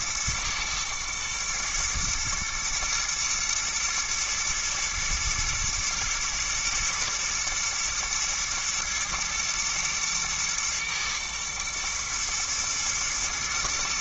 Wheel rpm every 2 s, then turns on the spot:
110, 120, 110, 110, 120, 120, 120.
none